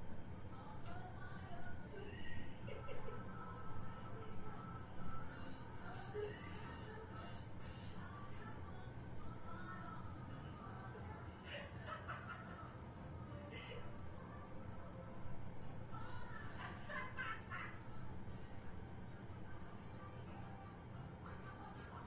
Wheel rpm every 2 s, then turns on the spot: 0, 0, 0, 0, 0, 0, 0, 0, 0, 0, 0.
none